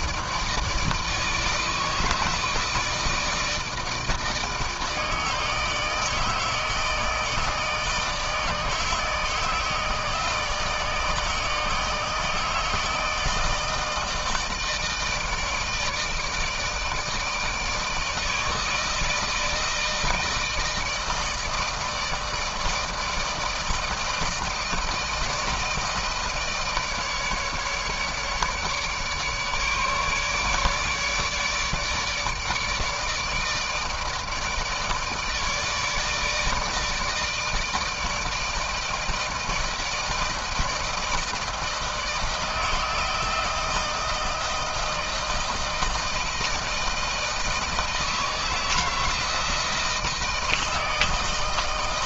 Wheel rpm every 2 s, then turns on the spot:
160, 160, 160, 160, 160, 160, 160, 160, 160, 160, 160, 160, 160, 150, 150, 150, 160, 160, 160, 160, 160, 160, 160, 160, 160, 160.
none